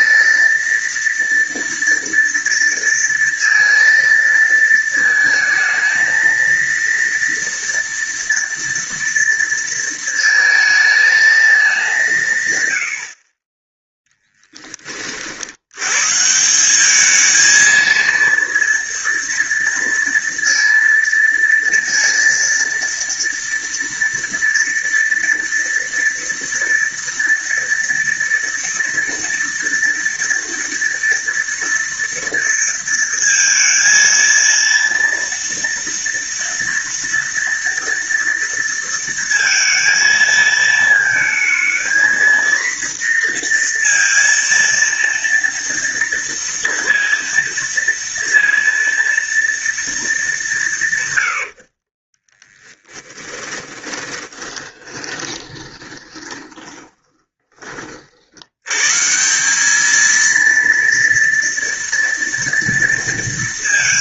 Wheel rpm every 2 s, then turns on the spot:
230, 230, 230, 230, 230, 220, 120, 30, 180, 230, 230, 230, 230, 230, 230, 230, 230, 230, 230, 230, 220, 240, 230, 230, 230, 170, 10, 20, 20, 100, 230, 230.
52-58